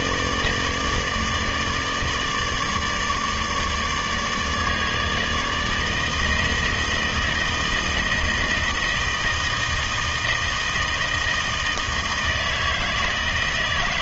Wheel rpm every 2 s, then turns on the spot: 160, 150, 150, 160, 160, 160, 160.
none